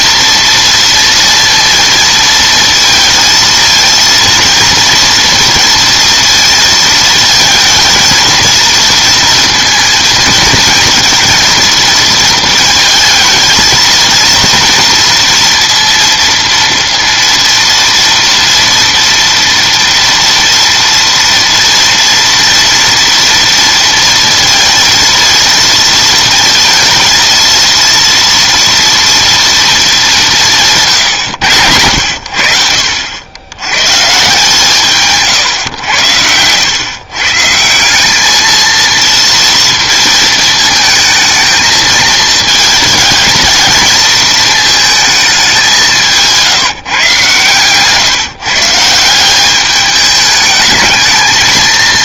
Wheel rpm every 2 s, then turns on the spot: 230, 230, 230, 230, 230, 230, 230, 230, 230, 230, 230, 230, 230, 230, 230, 160, 70, 160, 100, 220, 220, 220, 220, 170, 150, 210.
none